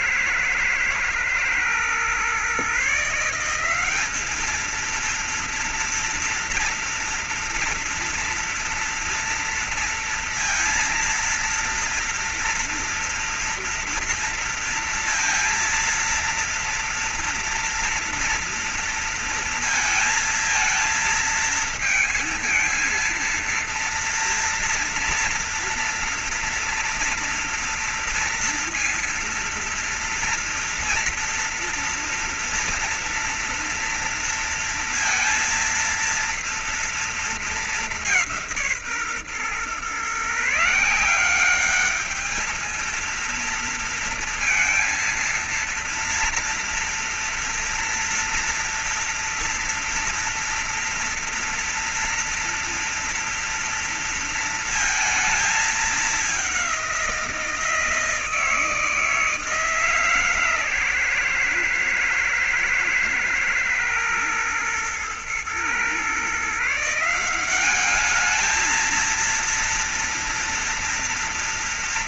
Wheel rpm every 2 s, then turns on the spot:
110, 130, 200, 230, 230, 230, 230, 230, 230, 240, 220, 220, 230, 230, 230, 230, 230, 230, 230, 190, 140, 220, 230, 230, 230, 230, 230, 230, 200, 160, 150, 120, 110, 140, 210, 240.
none